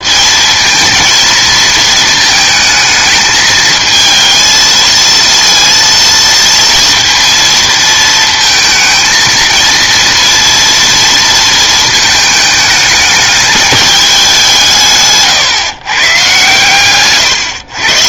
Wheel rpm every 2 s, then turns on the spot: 220, 220, 230, 230, 230, 230, 220, 160, 130.
none